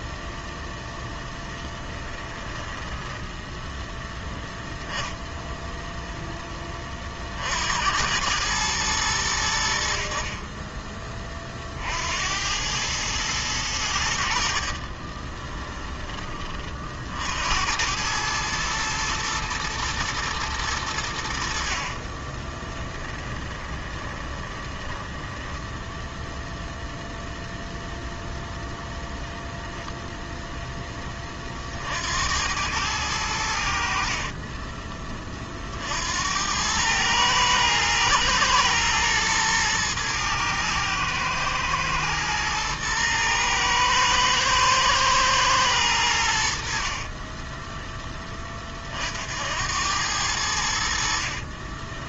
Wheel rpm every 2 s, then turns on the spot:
0, 10, 0, 30, 100, 30, 110, 30, 60, 110, 90, 10, 10, 0, 0, 20, 100, 30, 110, 110, 110, 110, 110, 40, 50, 60.
2-4 14-16 22-26 46-48